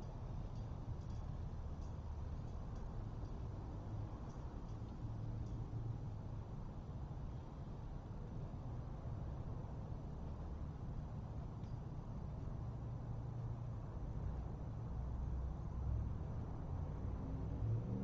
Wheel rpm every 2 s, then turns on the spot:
0, 0, 0, 0, 0, 0, 0, 0, 0.
none